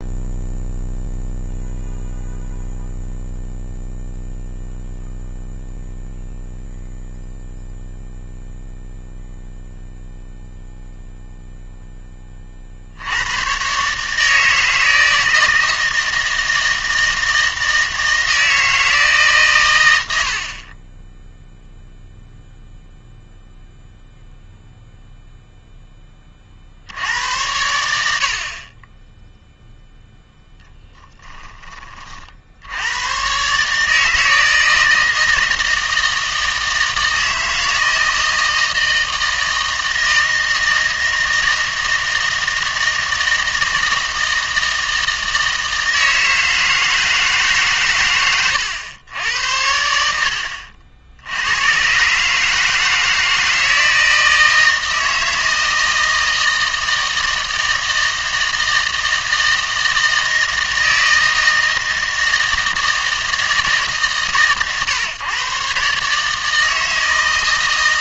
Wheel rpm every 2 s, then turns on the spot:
0, 0, 0, 0, 0, 0, 50, 160, 160, 160, 30, 0, 0, 60, 30, 10, 90, 160, 160, 160, 160, 160, 160, 160, 110, 70, 160, 160, 160, 160, 160, 160, 120, 160.
30-32